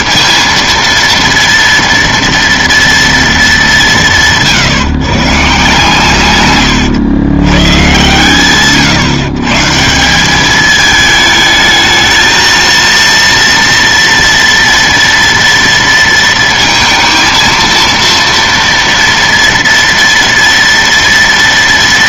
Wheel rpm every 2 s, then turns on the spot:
230, 230, 150, 140, 120, 200, 220, 230, 220, 230, 230.
6-8